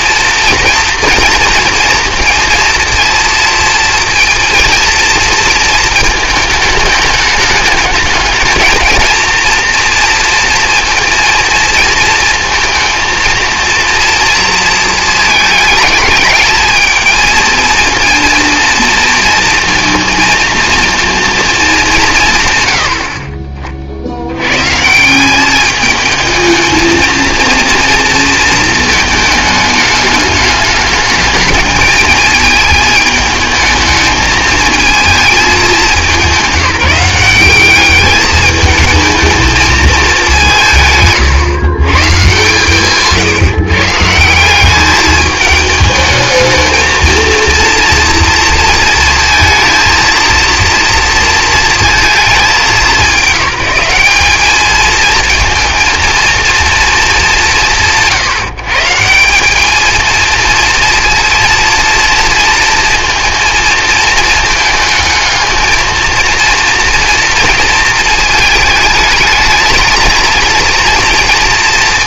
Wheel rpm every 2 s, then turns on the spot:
240, 230, 230, 210, 210, 230, 230, 230, 220, 230, 230, 110, 130, 220, 220, 210, 210, 220, 200, 220, 170, 150, 160, 220, 230, 230, 210, 210, 230, 150, 230, 230, 220, 230, 220, 230.
none